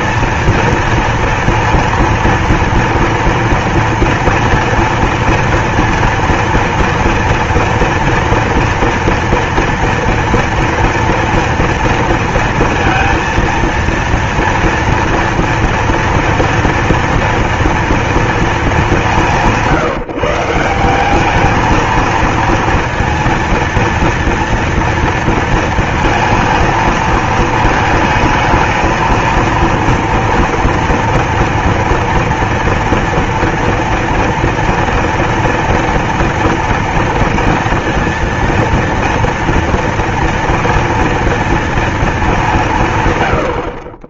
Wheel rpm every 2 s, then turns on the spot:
230, 230, 230, 230, 230, 230, 230, 230, 230, 230, 160, 230, 230, 230, 220, 230, 230, 230, 230, 230, 230, 220.
none